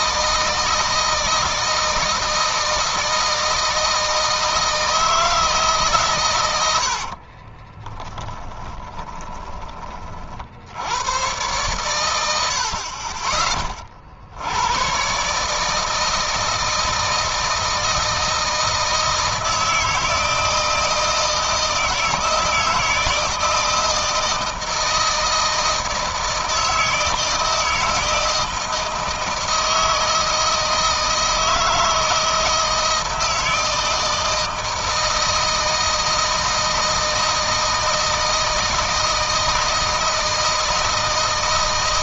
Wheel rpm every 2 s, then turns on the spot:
160, 160, 160, 90, 20, 80, 60, 100, 160, 160, 160, 160, 160, 160, 160, 160, 160, 160, 160, 160, 160.
6-10